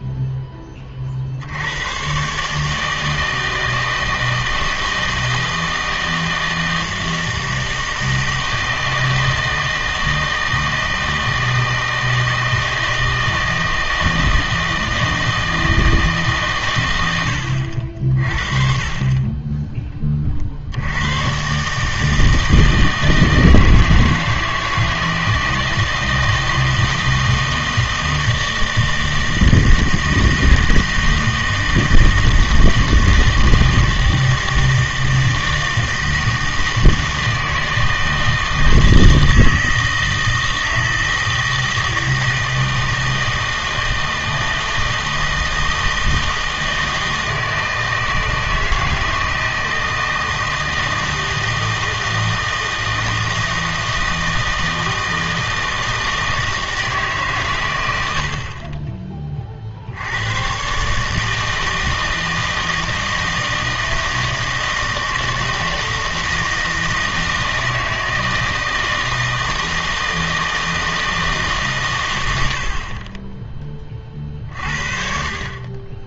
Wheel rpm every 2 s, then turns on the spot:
20, 150, 160, 160, 160, 160, 160, 160, 130, 40, 70, 160, 160, 160, 160, 160, 160, 160, 160, 160, 160, 160, 160, 160, 160, 160, 160, 160, 160, 30, 130, 160, 160, 160, 160, 160, 60, 50.
none